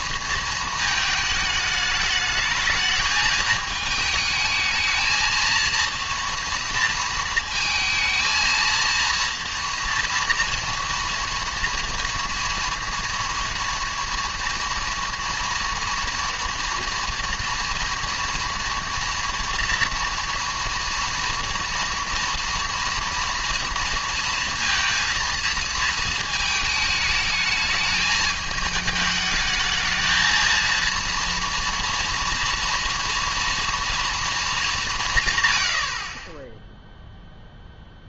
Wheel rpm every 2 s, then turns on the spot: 230, 220, 220, 230, 230, 230, 230, 230, 230, 230, 240, 230, 230, 220, 210, 230, 230, 210, 10.
none